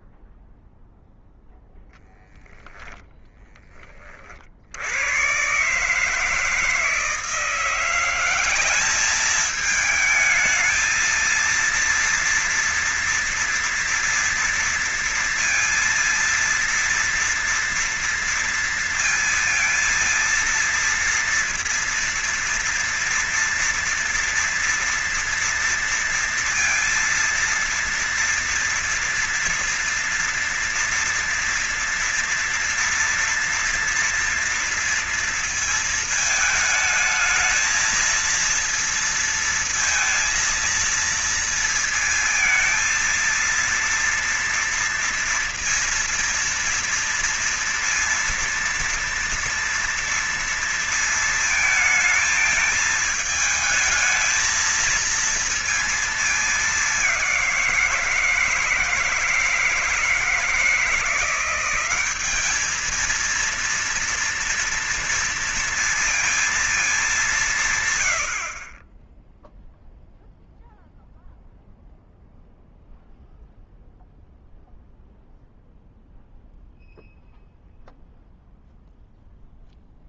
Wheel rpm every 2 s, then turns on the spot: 0, 0, 70, 160, 180, 220, 230, 230, 230, 230, 230, 230, 230, 230, 230, 230, 230, 230, 220, 230, 230, 230, 230, 230, 230, 230, 220, 220, 220, 170, 160, 200, 230, 230, 80, 0, 0, 0, 0, 0.
none